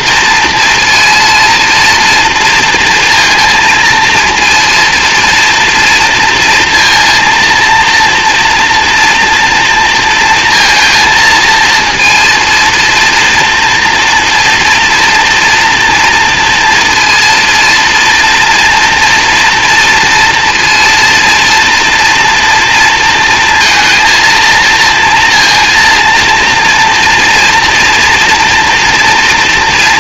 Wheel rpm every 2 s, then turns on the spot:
230, 230, 230, 230, 240, 220, 230, 230, 230, 230, 230, 230, 230, 230, 230.
none